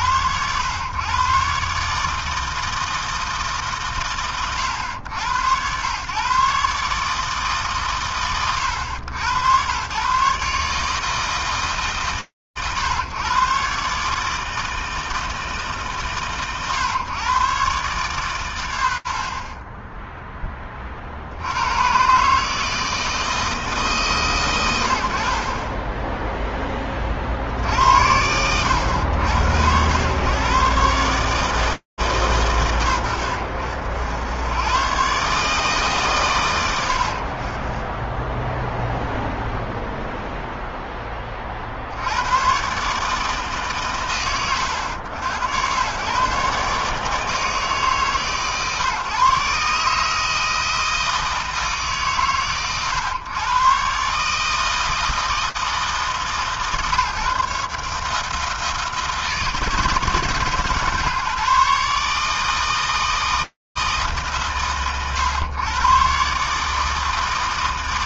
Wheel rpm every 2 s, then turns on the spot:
90, 140, 120, 120, 130, 120, 130, 150, 130, 140, 10, 110, 140, 20, 70, 100, 140, 70, 140, 20, 0, 40, 120, 120, 150, 150, 130, 130, 150, 140, 160, 140, 150, 120.
none